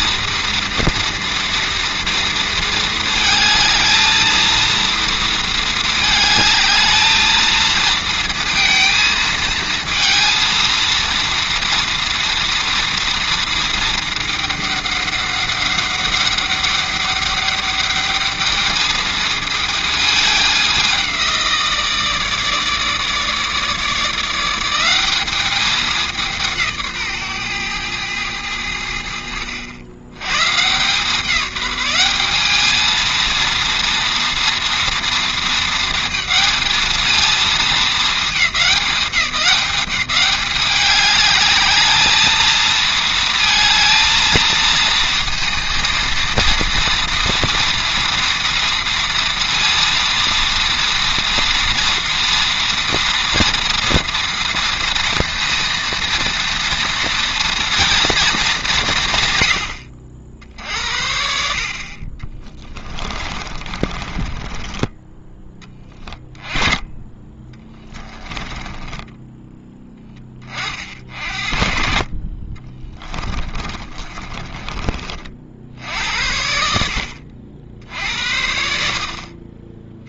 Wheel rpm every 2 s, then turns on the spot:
230, 230, 230, 220, 230, 230, 230, 200, 200, 220, 190, 150, 190, 150, 80, 160, 220, 230, 220, 200, 200, 220, 230, 230, 230, 230, 230, 230, 230, 180, 60, 30, 20, 20, 10, 40, 30, 40, 70, 50.
62-66 68-70 72-74